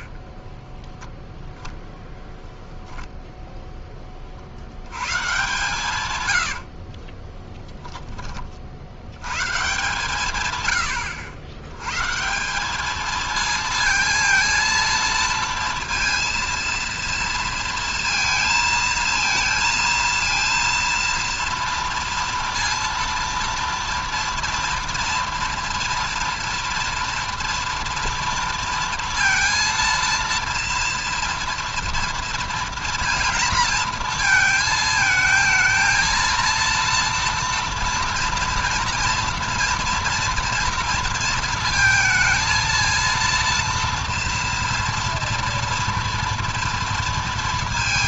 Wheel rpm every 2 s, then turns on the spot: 0, 0, 60, 90, 30, 130, 190, 230, 230, 230, 230, 230, 230, 230, 230, 230, 230, 220, 230, 230, 230, 230, 230, 230.
6-8